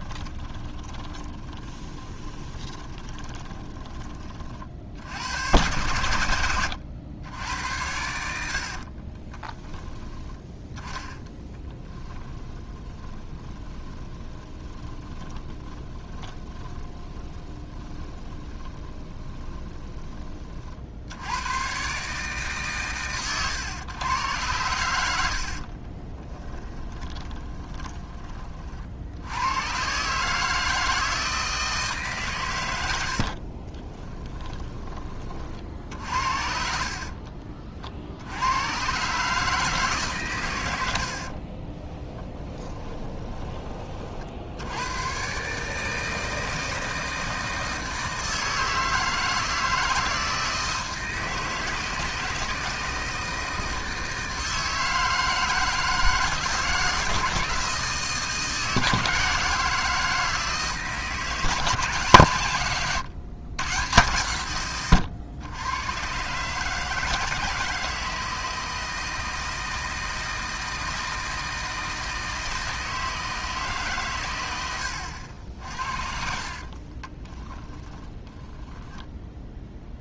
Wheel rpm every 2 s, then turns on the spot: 20, 20, 60, 90, 40, 20, 20, 30, 20, 20, 60, 130, 90, 20, 50, 160, 90, 20, 50, 130, 90, 10, 110, 160, 160, 160, 160, 160, 160, 160, 160, 130, 120, 160, 160, 160, 160, 60, 30, 10.
0-4 8-20 26-28 36-38 42-44 76-78